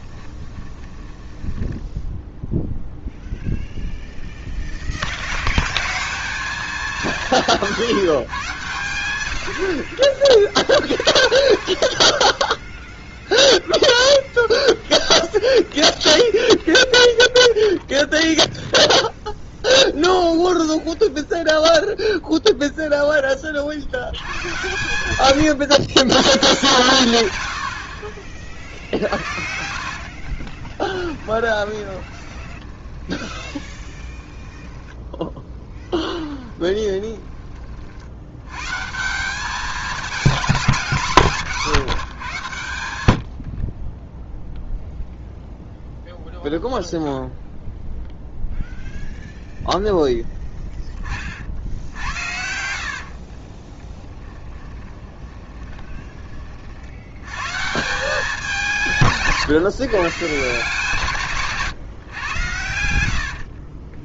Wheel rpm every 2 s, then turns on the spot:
10, 0, 30, 190, 100, 30, 0, 0, 0, 0, 0, 0, 100, 130, 60, 20, 20, 10, 10, 150, 200, 100, 0, 0, 0, 20, 60, 20, 60, 170, 150, 90.
0-2 30-34 36-38 40-42 52-56